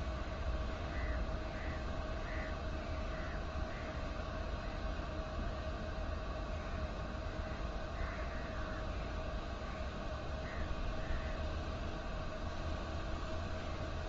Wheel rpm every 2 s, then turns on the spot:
0, 0, 0, 0, 0, 0, 0.
none